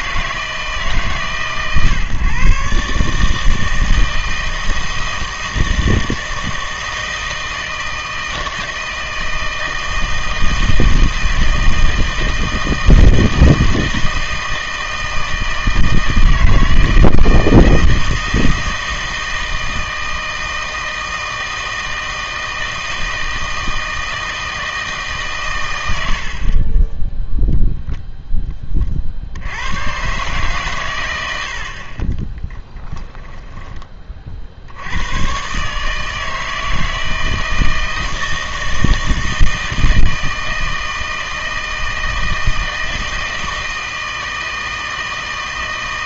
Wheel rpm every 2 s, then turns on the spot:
160, 140, 160, 160, 160, 160, 160, 160, 160, 160, 160, 160, 160, 30, 30, 120, 10, 80, 160, 160, 160, 160, 160.
32-34